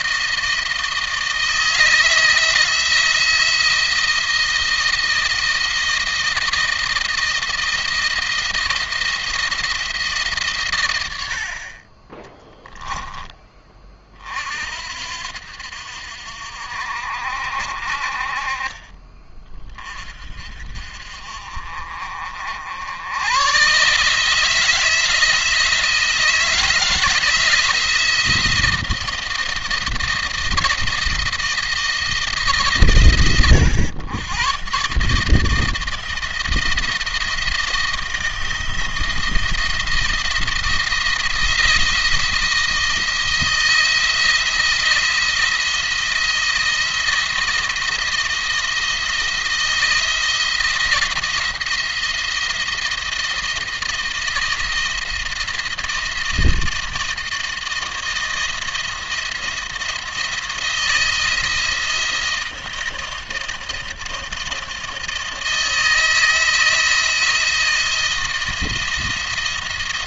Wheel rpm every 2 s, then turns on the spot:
160, 160, 160, 160, 170, 130, 10, 60, 60, 30, 50, 80, 160, 170, 170, 170, 140, 130, 170, 170, 170, 160, 170, 170, 160, 170, 170, 160, 160, 170, 170, 170, 170, 160, 170.
12-14